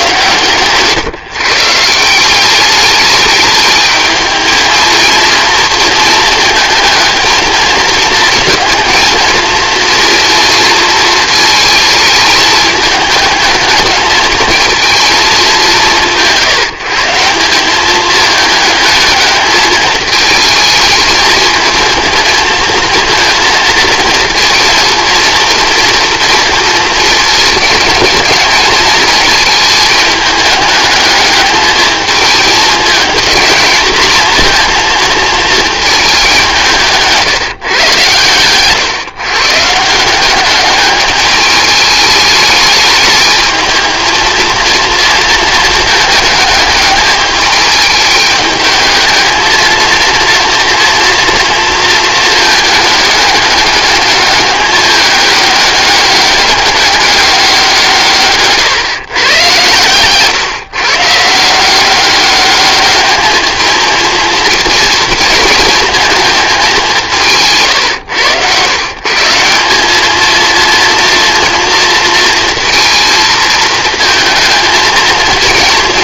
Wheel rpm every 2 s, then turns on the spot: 140, 200, 220, 220, 230, 230, 210, 220, 160, 210, 220, 230, 230, 230, 220, 220, 220, 230, 170, 130, 200, 210, 230, 210, 220, 230, 220, 210, 200, 130, 130, 210, 230, 210, 120, 230, 230, 220.
0-2